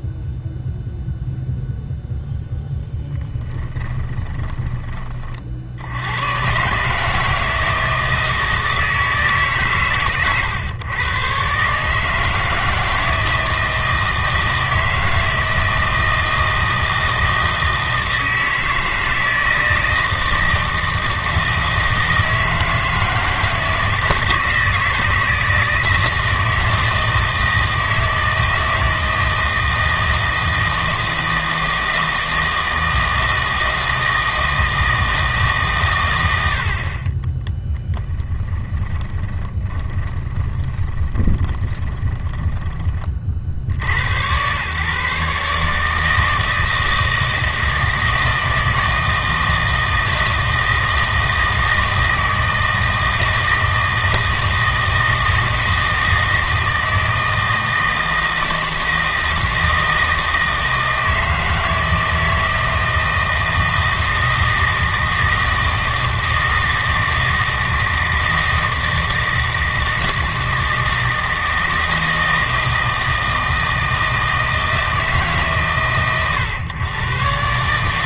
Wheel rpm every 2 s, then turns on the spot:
0, 0, 20, 140, 160, 120, 160, 160, 160, 160, 160, 160, 160, 160, 160, 160, 160, 160, 60, 10, 20, 20, 130, 160, 160, 160, 160, 160, 160, 160, 160, 160, 160, 160, 160, 160, 160, 160, 120.
38-42